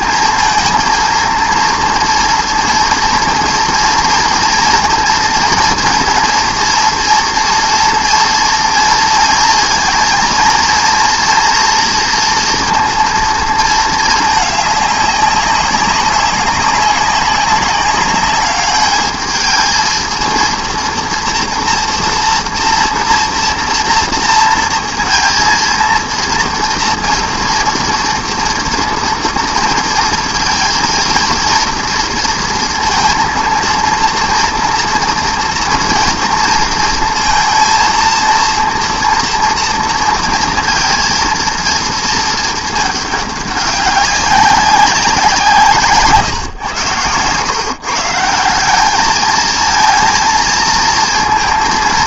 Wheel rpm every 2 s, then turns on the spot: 230, 230, 240, 230, 230, 240, 230, 200, 200, 210, 230, 240, 230, 240, 230, 230, 230, 230, 230, 230, 230, 210, 180, 120, 220, 230.
none